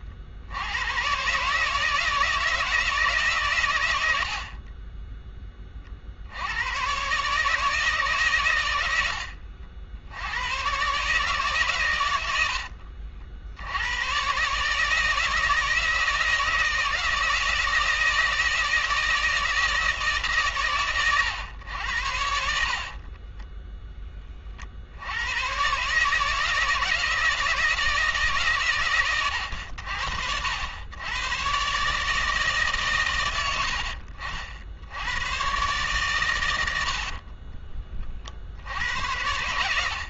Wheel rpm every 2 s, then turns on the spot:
90, 160, 30, 110, 100, 120, 70, 150, 160, 160, 110, 50, 40, 160, 130, 90, 150, 70, 90, 70.
22-24 36-38